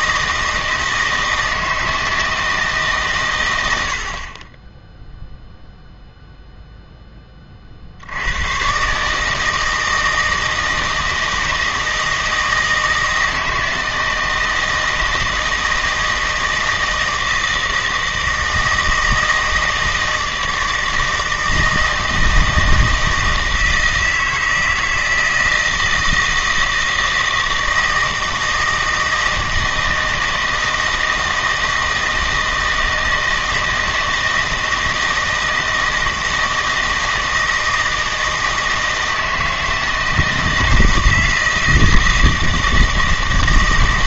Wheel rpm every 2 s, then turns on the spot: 160, 150, 10, 0, 130, 160, 160, 160, 160, 160, 160, 160, 160, 160, 160, 160, 160, 160, 160, 160, 160, 160.
none